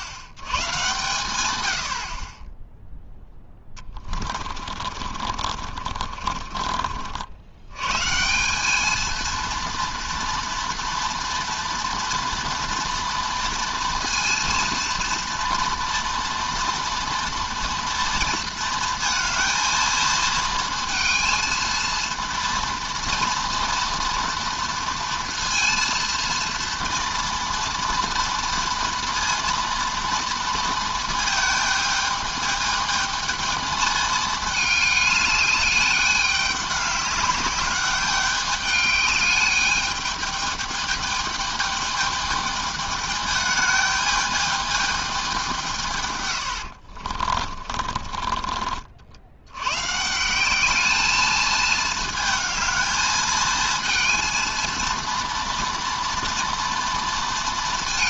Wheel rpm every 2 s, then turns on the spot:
90, 10, 40, 40, 190, 230, 240, 240, 230, 230, 220, 230, 230, 230, 230, 230, 220, 210, 200, 210, 220, 210, 210, 90, 40, 200, 220, 230, 230.
4-8 46-48